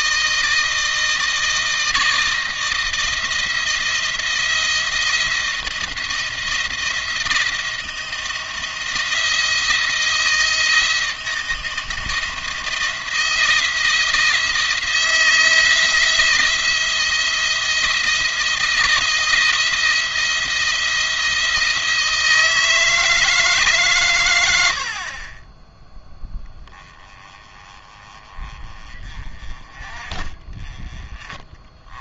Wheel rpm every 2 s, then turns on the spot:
160, 160, 170, 170, 170, 160, 170, 170, 170, 160, 170, 160, 80, 10, 30, 30.
none